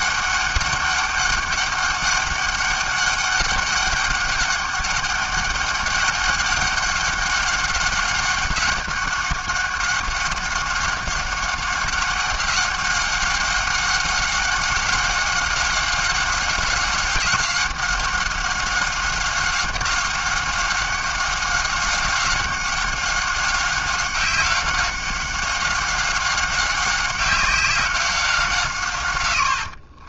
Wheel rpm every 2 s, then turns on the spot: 200, 200, 200, 200, 190, 190, 190, 190, 190, 190, 190, 190, 190, 190, 160.
none